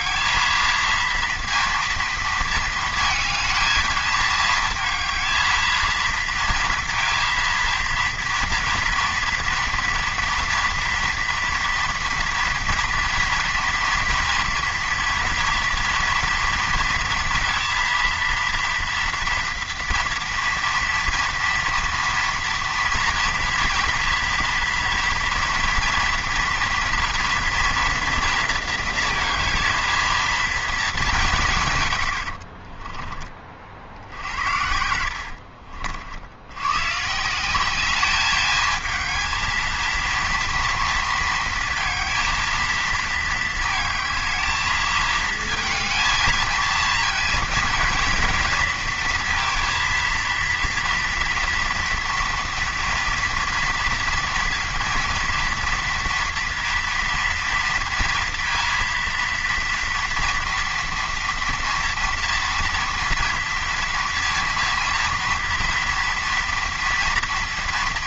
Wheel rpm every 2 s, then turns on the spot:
230, 230, 220, 230, 230, 230, 230, 230, 230, 230, 230, 240, 240, 240, 230, 220, 40, 80, 110, 220, 230, 230, 220, 230, 230, 230, 230, 230, 230, 230, 230, 230, 240, 230.
32-36